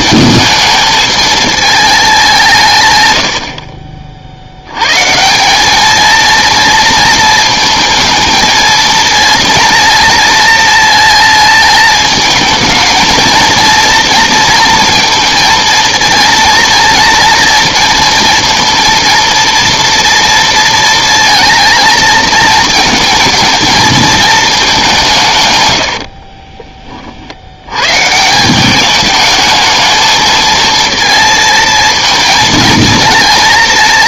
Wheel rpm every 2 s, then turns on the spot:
220, 150, 100, 230, 220, 230, 230, 230, 230, 230, 230, 220, 200, 40, 190, 220, 220.
none